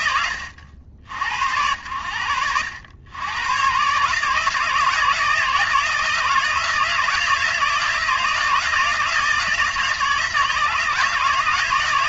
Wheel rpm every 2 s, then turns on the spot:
60, 100, 160, 160, 160, 160.
none